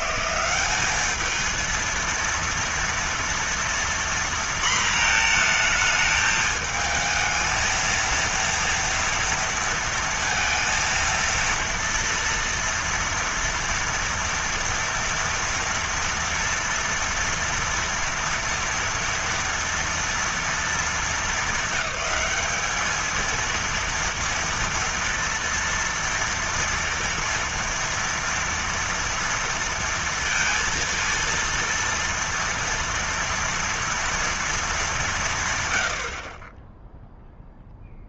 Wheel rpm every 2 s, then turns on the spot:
200, 230, 230, 220, 230, 230, 230, 240, 230, 230, 230, 220, 230, 230, 230, 230, 230, 220, 20.
none